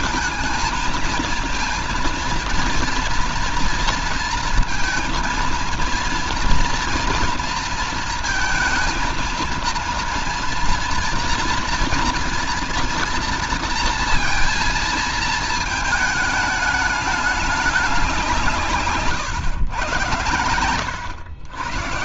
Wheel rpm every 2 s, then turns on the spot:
230, 230, 230, 230, 230, 230, 230, 230, 210, 170, 100.
none